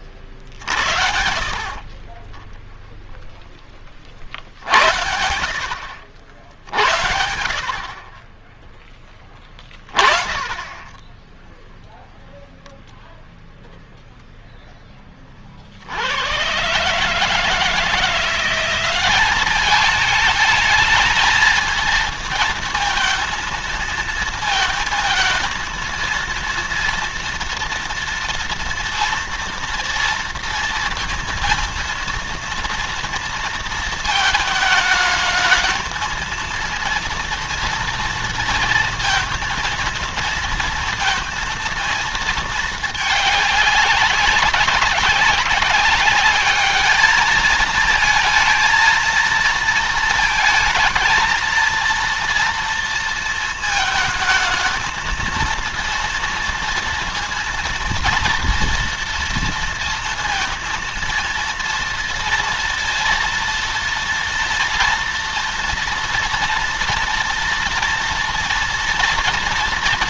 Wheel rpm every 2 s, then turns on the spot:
60, 10, 70, 60, 10, 10, 0, 10, 120, 190, 220, 220, 220, 240, 230, 230, 230, 220, 230, 230, 230, 210, 190, 210, 220, 220, 230, 220, 230, 230, 230, 230, 240, 230, 230.
none